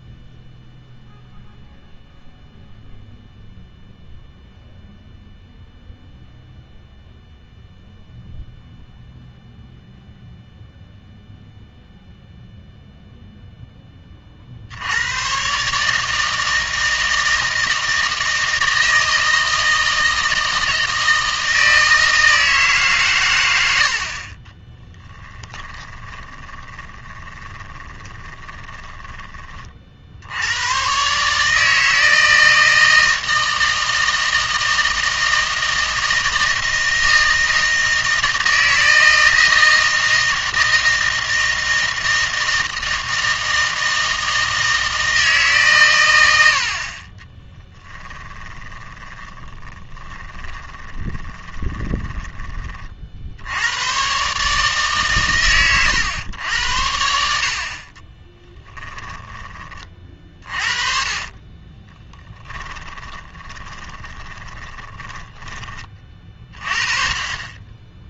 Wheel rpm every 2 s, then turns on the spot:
0, 0, 0, 0, 0, 0, 0, 80, 160, 160, 160, 150, 20, 20, 10, 100, 160, 160, 160, 160, 160, 160, 160, 70, 20, 10, 30, 150, 90, 10, 40, 10, 10, 30.
24-30 48-52 58-60 62-66